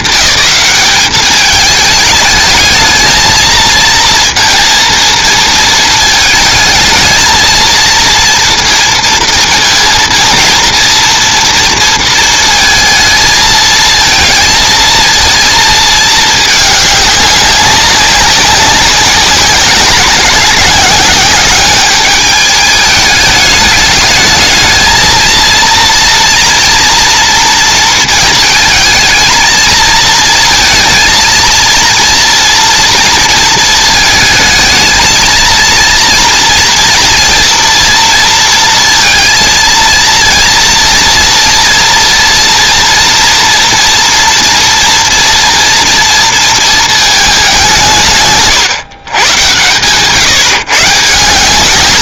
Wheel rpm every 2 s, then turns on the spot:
210, 210, 230, 220, 230, 230, 220, 220, 210, 190, 190, 210, 220, 230, 220, 230, 230, 220, 230, 230, 230, 230, 230, 230, 160, 150.
none